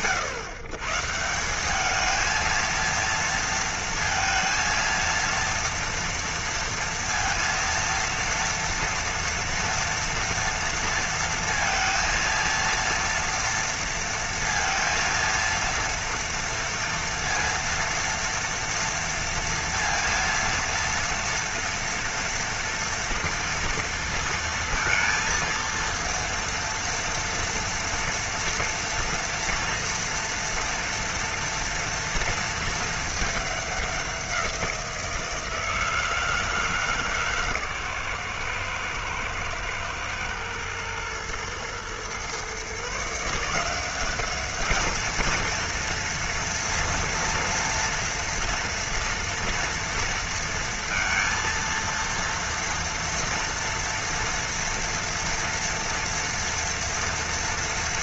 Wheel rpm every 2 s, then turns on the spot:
140, 230, 230, 230, 230, 230, 230, 230, 230, 230, 230, 230, 230, 230, 230, 230, 220, 170, 150, 110, 110, 140, 220, 230, 230, 230, 230, 230, 230.
none